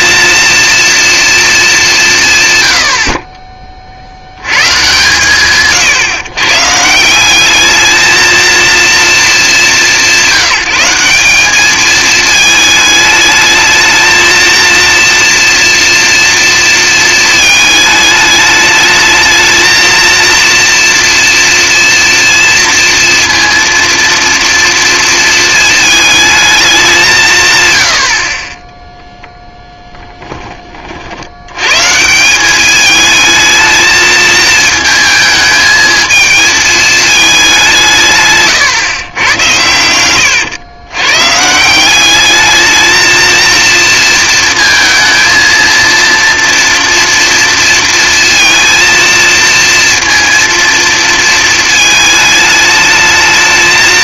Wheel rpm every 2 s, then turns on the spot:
230, 120, 110, 140, 220, 190, 220, 230, 230, 210, 230, 230, 230, 210, 10, 20, 200, 220, 220, 140, 110, 210, 230, 230, 230, 230, 210.
38-40